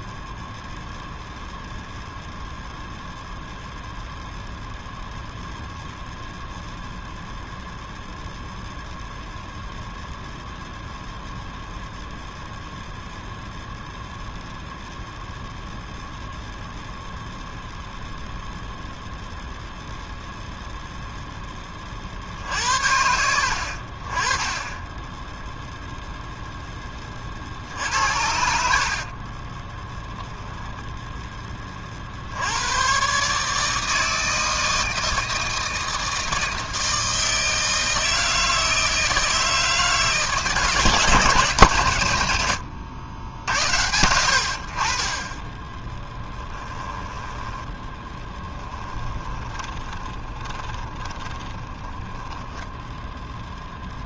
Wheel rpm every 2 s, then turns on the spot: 0, 0, 0, 0, 0, 0, 0, 0, 0, 0, 0, 70, 20, 10, 50, 0, 100, 160, 160, 160, 160, 90, 60, 10, 10, 20, 10.
48-52